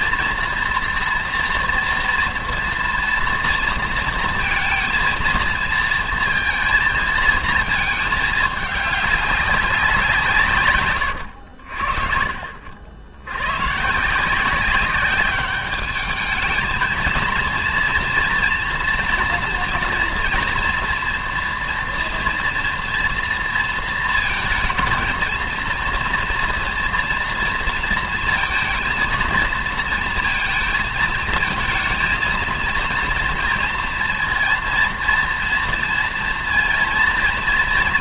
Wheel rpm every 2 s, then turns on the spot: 240, 230, 230, 220, 200, 120, 90, 190, 230, 240, 230, 240, 230, 230, 230, 230, 230, 230, 230.
none